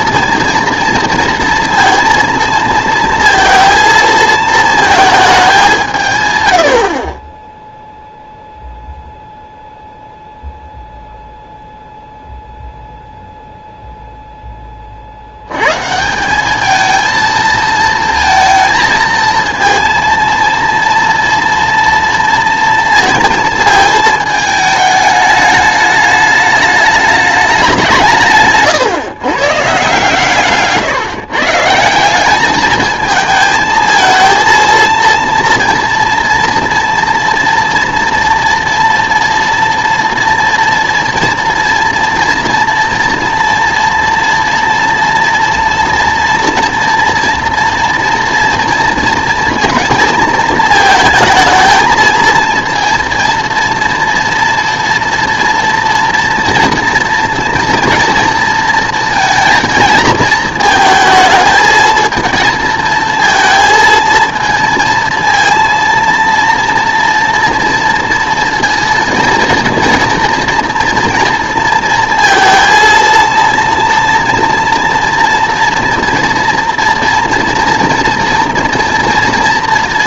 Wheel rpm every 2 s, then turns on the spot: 230, 230, 220, 80, 0, 0, 0, 20, 210, 220, 230, 230, 210, 210, 140, 150, 210, 230, 230, 230, 240, 240, 240, 230, 230, 220, 230, 230, 230, 230, 220, 220, 230, 230, 230, 230, 230, 240, 230, 230.
none